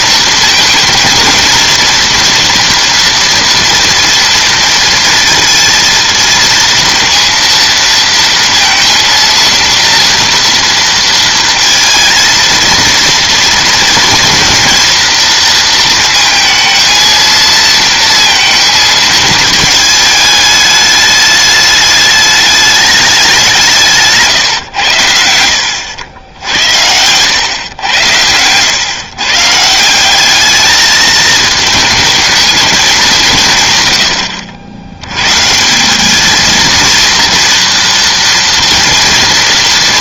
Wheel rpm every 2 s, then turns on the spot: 230, 230, 230, 230, 230, 230, 230, 230, 220, 220, 210, 210, 130, 80, 110, 210, 210, 80, 220, 230.
26-28